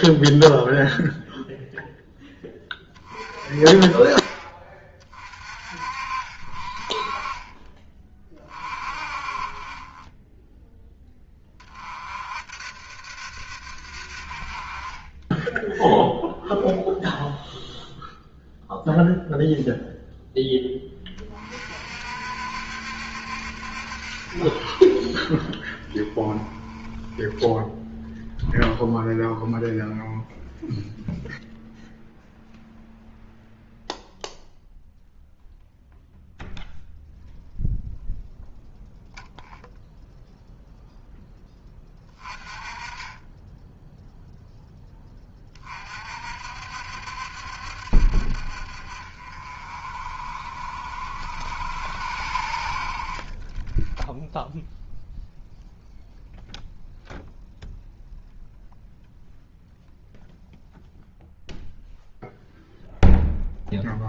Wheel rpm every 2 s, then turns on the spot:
0, 20, 40, 40, 30, 10, 50, 20, 0, 0, 20, 70, 30, 20, 0, 0, 0, 0, 0, 0, 0, 20, 10, 60, 50, 50, 50, 0, 0, 0, 0, 0.
none